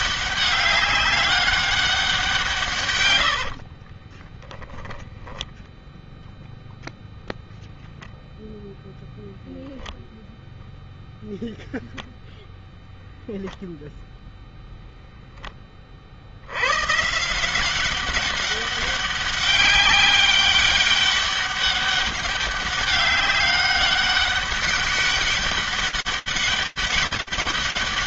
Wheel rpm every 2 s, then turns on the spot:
200, 150, 10, 0, 0, 0, 0, 0, 120, 190, 200, 200, 200, 200.
2-6